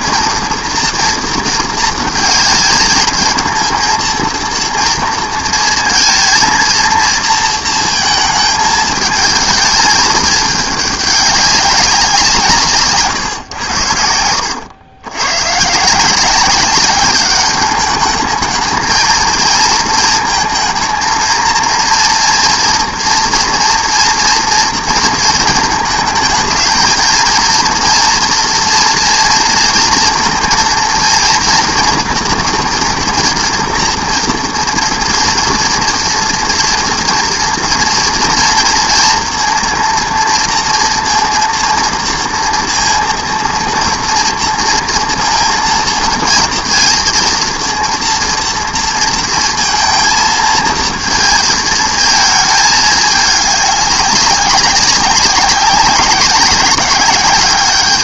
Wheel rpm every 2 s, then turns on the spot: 230, 220, 230, 230, 220, 210, 140, 100, 200, 220, 230, 240, 230, 230, 240, 230, 240, 230, 230, 230, 230, 230, 230, 230, 230, 230, 210, 190, 200.
none